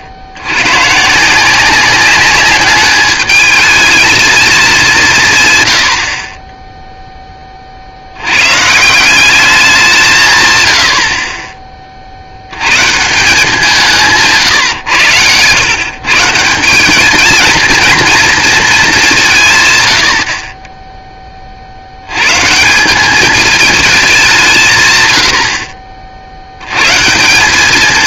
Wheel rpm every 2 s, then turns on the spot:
90, 200, 210, 20, 130, 110, 100, 130, 180, 230, 30, 160, 180, 80.
none